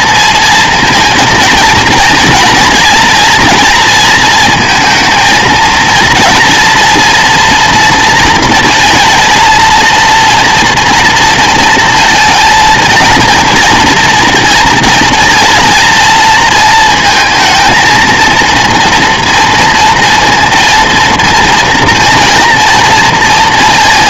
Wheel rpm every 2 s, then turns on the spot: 230, 230, 230, 230, 230, 230, 220, 230, 230, 230, 230, 230.
none